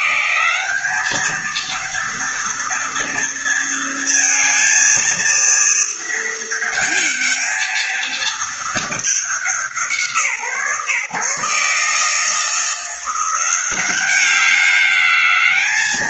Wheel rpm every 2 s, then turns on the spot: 210, 240, 230, 220, 210, 140, 180, 200.
none